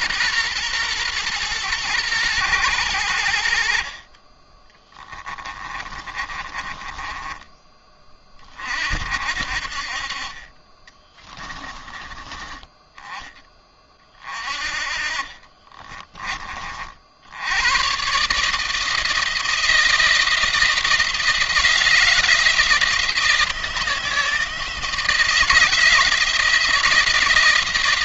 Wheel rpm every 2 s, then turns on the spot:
120, 100, 20, 20, 50, 20, 10, 40, 50, 160, 170, 160, 160, 160.
4-8 10-12 14-16